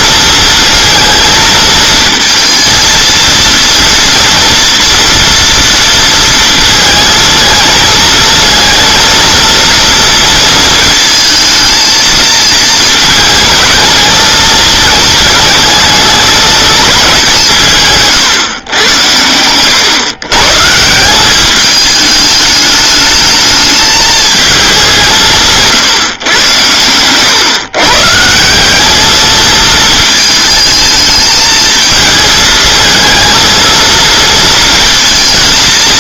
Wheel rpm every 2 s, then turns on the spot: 230, 230, 230, 220, 230, 230, 220, 220, 210, 120, 160, 210, 210, 110, 200, 220, 220, 230.
none